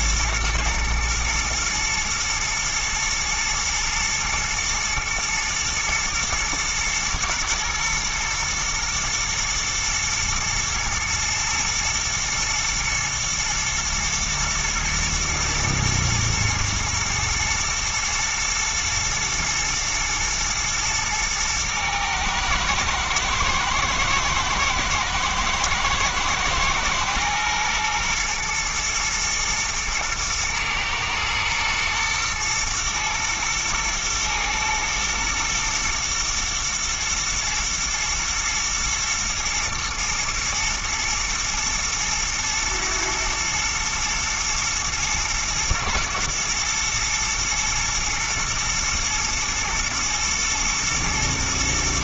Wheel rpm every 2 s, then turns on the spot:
110, 110, 120, 110, 110, 110, 110, 110, 110, 110, 110, 110, 120, 110, 110, 110, 110, 110, 120, 120, 120, 110, 120, 120, 110, 120.
none